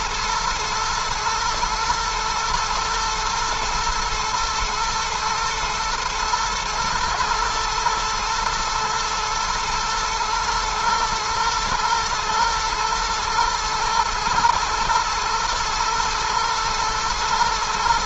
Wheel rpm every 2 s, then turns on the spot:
110, 120, 110, 120, 120, 120, 110, 120, 110.
none